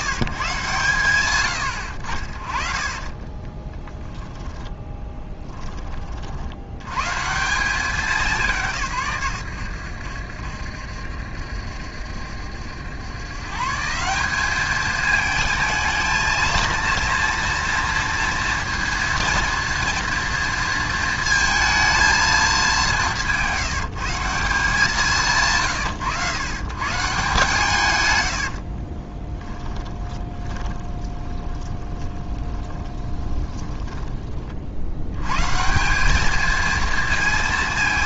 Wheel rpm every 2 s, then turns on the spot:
130, 30, 10, 80, 150, 70, 90, 210, 230, 230, 230, 190, 180, 140, 40, 20, 20, 80, 220.
2-6 28-34